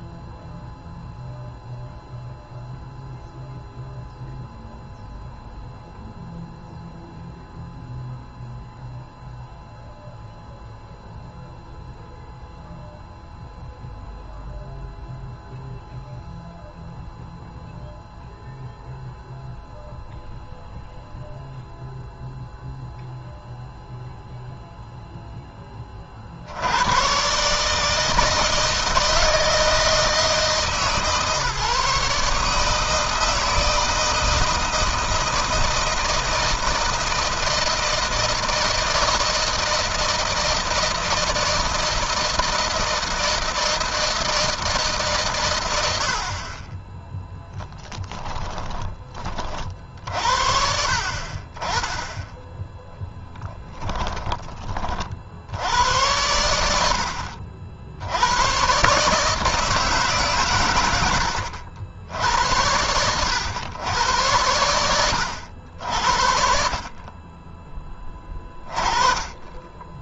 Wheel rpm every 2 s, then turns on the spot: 0, 0, 0, 0, 0, 0, 0, 0, 0, 0, 0, 0, 0, 110, 160, 150, 160, 160, 160, 160, 160, 160, 140, 20, 40, 40, 10, 40, 70, 140, 110, 80, 90, 40, 20.
46-48 52-54